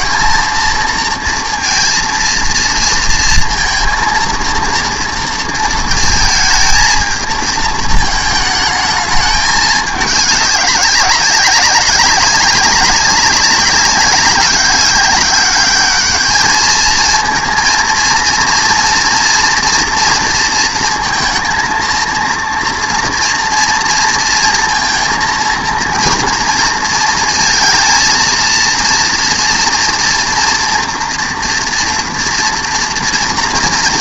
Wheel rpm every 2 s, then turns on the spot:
230, 230, 230, 220, 220, 200, 190, 200, 220, 230, 230, 230, 230, 230, 230, 240, 230.
none